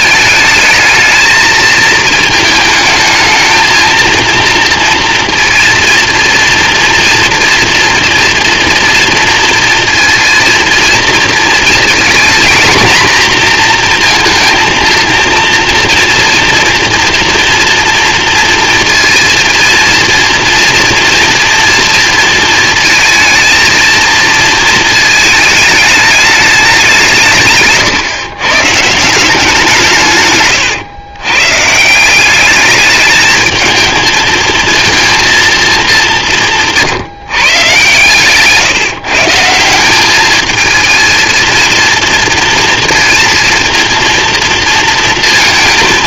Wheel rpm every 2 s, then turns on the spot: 220, 220, 230, 230, 230, 230, 230, 230, 240, 230, 230, 220, 220, 190, 150, 120, 210, 220, 160, 150, 220, 230, 230.
none